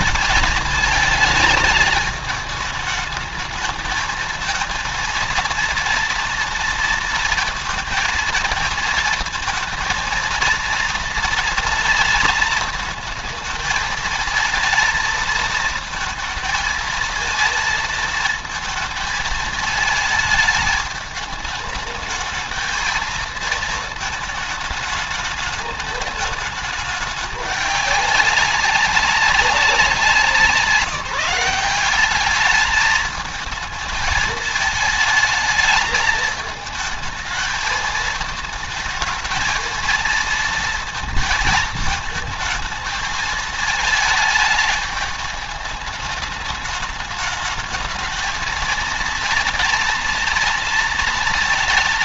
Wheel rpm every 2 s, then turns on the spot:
220, 210, 230, 230, 230, 230, 220, 220, 220, 220, 210, 220, 210, 210, 190, 170, 210, 210, 220, 220, 220, 220, 210, 210, 230, 230.
none